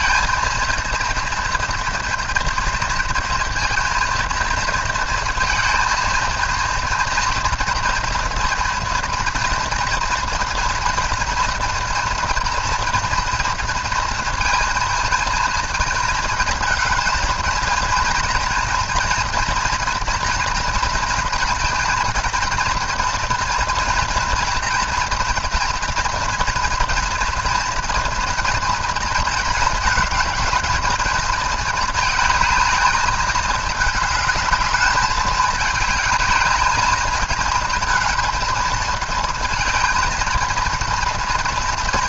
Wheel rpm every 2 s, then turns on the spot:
230, 230, 230, 230, 230, 230, 230, 230, 220, 230, 240, 230, 230, 230, 230, 220, 220, 220, 210, 220, 230.
none